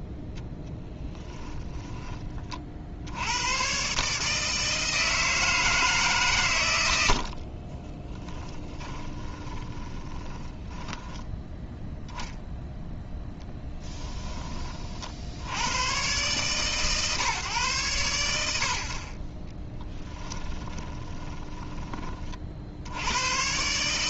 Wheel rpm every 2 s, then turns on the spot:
10, 40, 160, 120, 20, 20, 0, 20, 130, 70, 20, 60.
8-12 20-22